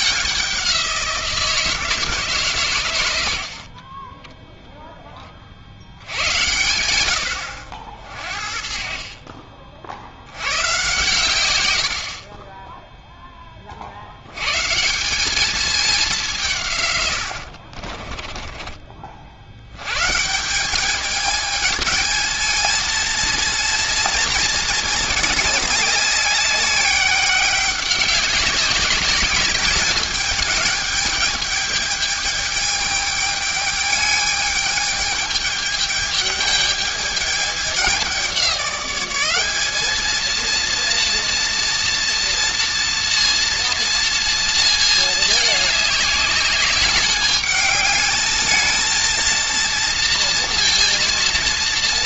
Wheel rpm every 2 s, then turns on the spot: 180, 130, 0, 100, 50, 100, 10, 130, 150, 20, 190, 220, 220, 190, 200, 210, 210, 210, 210, 190, 230, 230, 230, 200, 220, 230.
none